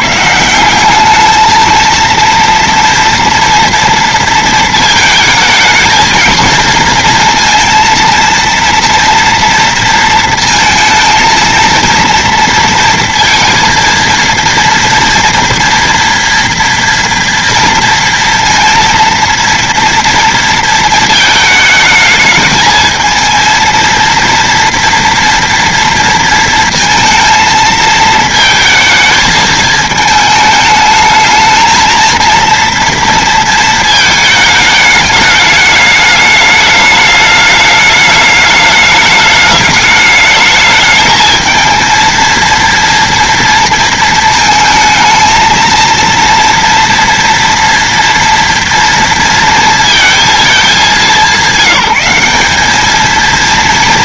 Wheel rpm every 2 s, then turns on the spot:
180, 230, 230, 230, 230, 230, 230, 230, 230, 230, 220, 220, 230, 230, 220, 220, 230, 210, 210, 210, 210, 230, 220, 240, 230, 210, 210.
none